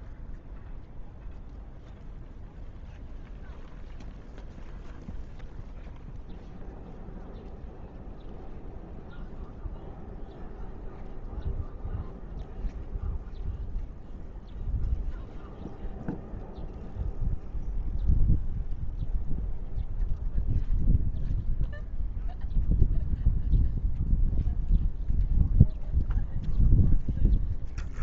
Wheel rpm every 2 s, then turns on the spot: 0, 0, 0, 0, 0, 0, 0, 0, 0, 0, 0, 0, 0, 0.
none